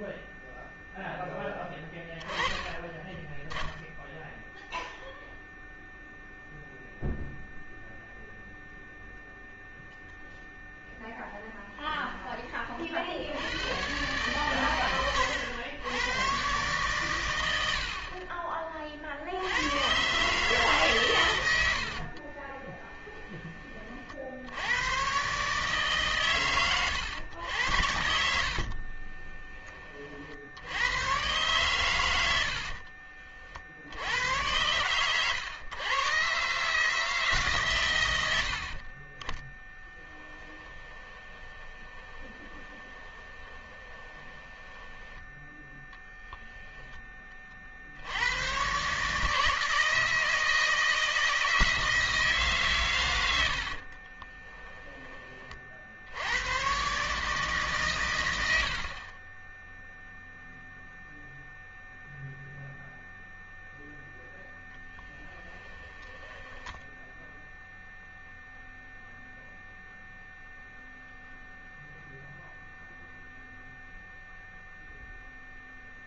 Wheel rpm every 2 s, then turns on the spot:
0, 10, 0, 0, 0, 0, 30, 120, 130, 40, 150, 30, 90, 110, 70, 80, 50, 110, 150, 60, 10, 20, 10, 10, 130, 160, 140, 20, 120, 80, 0, 0, 10, 10, 0, 0, 0, 0.
22-24 28-30 40-46 54-56 64-68